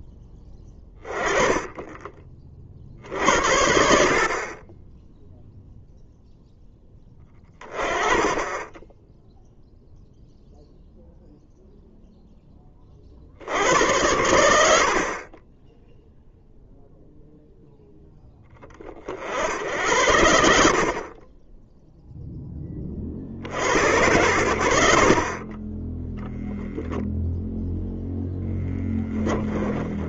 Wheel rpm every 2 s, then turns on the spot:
10, 50, 20, 10, 10, 0, 30, 60, 0, 40, 40, 40, 50, 0, 10.
28-30